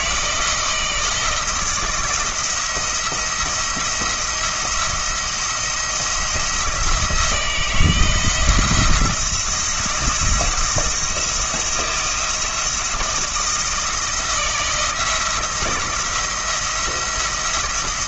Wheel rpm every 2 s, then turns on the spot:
160, 170, 170, 160, 170, 160, 160, 160, 170.
none